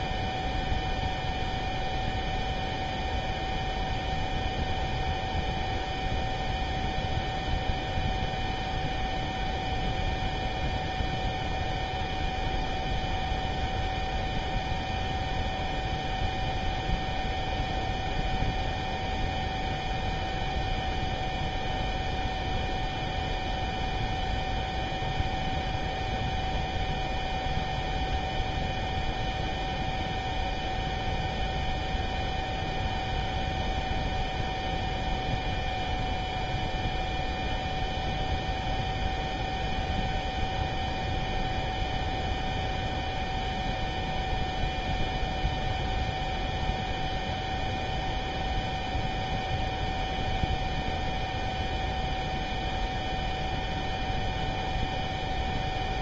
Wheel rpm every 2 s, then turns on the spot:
0, 0, 0, 0, 0, 0, 0, 0, 0, 0, 0, 0, 0, 0, 0, 0, 0, 0, 0, 0, 0, 0, 0, 0, 0, 0, 0, 0.
none